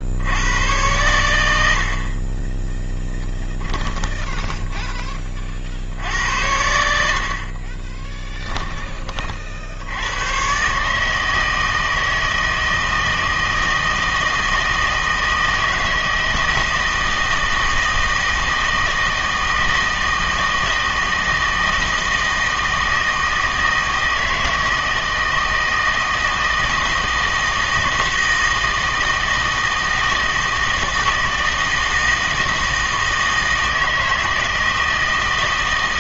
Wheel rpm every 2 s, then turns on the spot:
100, 20, 10, 80, 20, 130, 160, 160, 160, 160, 160, 160, 160, 160, 160, 160, 160, 160.
4-6